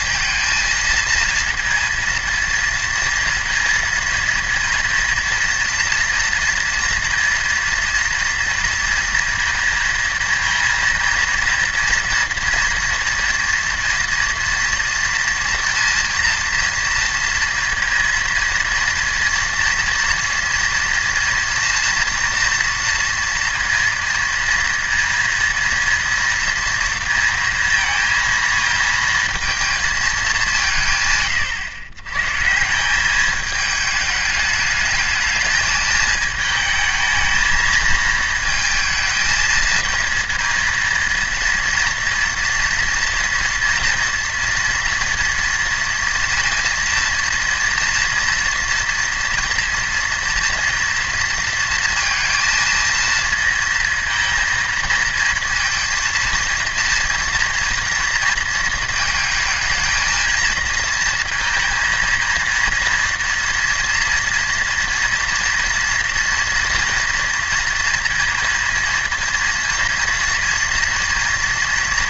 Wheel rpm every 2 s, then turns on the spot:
230, 230, 230, 230, 230, 230, 230, 230, 230, 230, 230, 230, 230, 230, 230, 140, 190, 210, 220, 220, 230, 230, 230, 230, 230, 230, 230, 230, 230, 230, 230, 230, 230, 230, 230, 240.
none